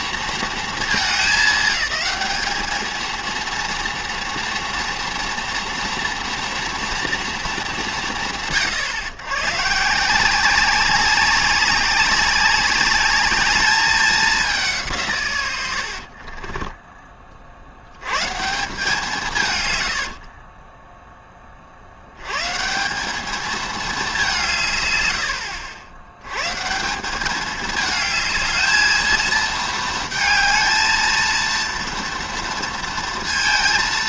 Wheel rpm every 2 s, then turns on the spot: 210, 220, 230, 230, 120, 190, 210, 150, 30, 180, 10, 200, 100, 180, 220, 230, 230.
none